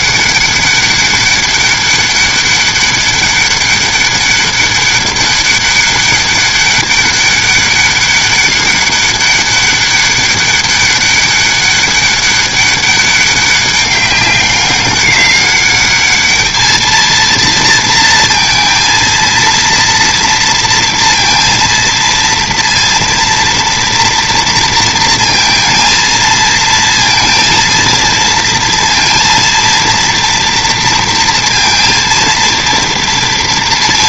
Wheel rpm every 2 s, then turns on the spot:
200, 200, 200, 200, 200, 200, 200, 200, 220, 230, 230, 230, 230, 230, 230, 230, 230.
none